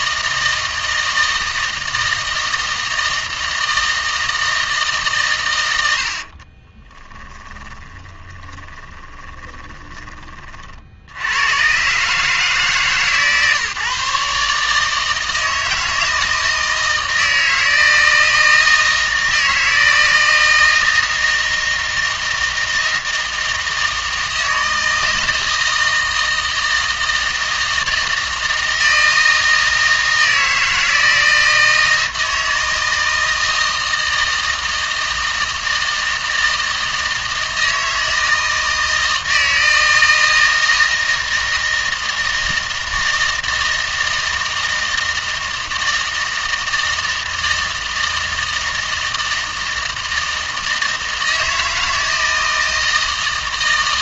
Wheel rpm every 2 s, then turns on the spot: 160, 160, 160, 30, 20, 50, 150, 150, 160, 160, 160, 160, 160, 160, 160, 160, 160, 160, 160, 160, 160, 160, 160, 160, 160, 160, 160.
6-10